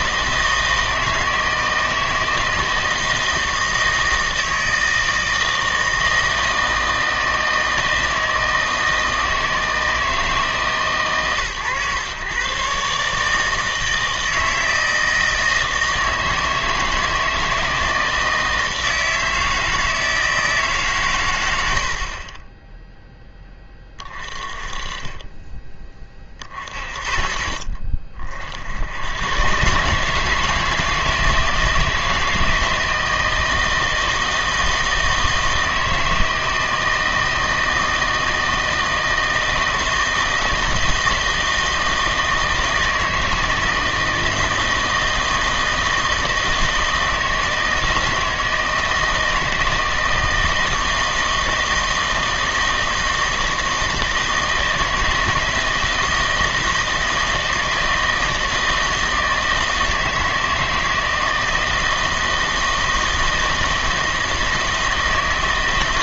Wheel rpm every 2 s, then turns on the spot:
160, 160, 160, 160, 160, 150, 140, 160, 160, 160, 140, 10, 20, 40, 80, 160, 160, 160, 160, 160, 160, 160, 160, 160, 160, 160, 160, 160, 160, 160, 160, 160, 160.
none